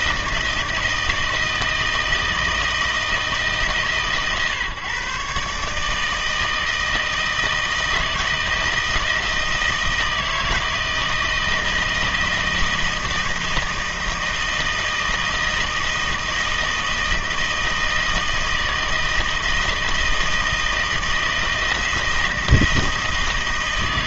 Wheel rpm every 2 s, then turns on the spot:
160, 160, 140, 160, 160, 160, 160, 160, 160, 160, 160, 160.
none